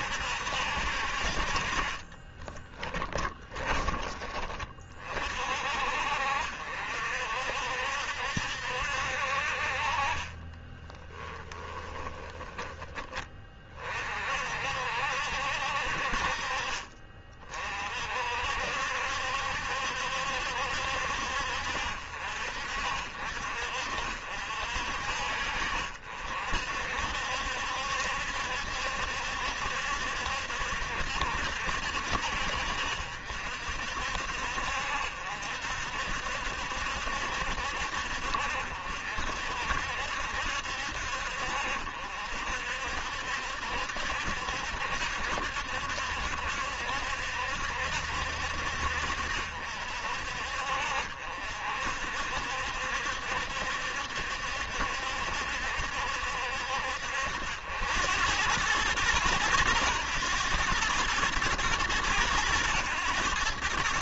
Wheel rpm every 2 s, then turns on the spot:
60, 20, 40, 60, 60, 30, 20, 60, 40, 60, 70, 50, 50, 60, 70, 70, 60, 60, 70, 60, 60, 60, 70, 70, 60, 60, 70, 70, 60, 110, 110, 100.
2-4 10-12